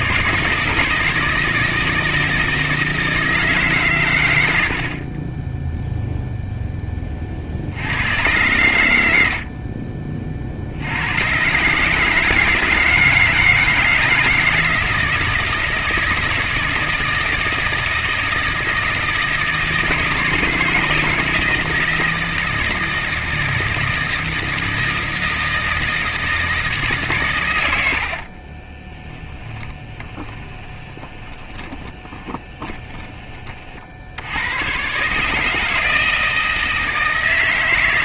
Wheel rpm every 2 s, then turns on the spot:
160, 160, 100, 0, 120, 50, 160, 160, 160, 160, 160, 160, 160, 160, 50, 20, 20, 90, 160.
28-34